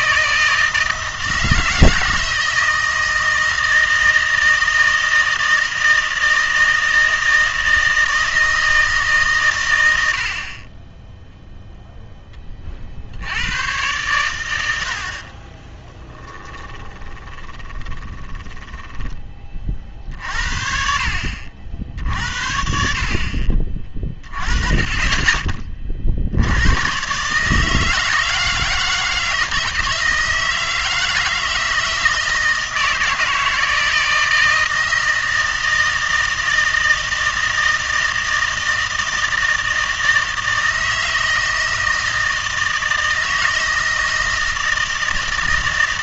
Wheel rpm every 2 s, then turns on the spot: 160, 160, 160, 160, 160, 30, 20, 90, 20, 10, 60, 60, 30, 90, 160, 160, 160, 160, 160, 160, 160, 160, 160.
16-20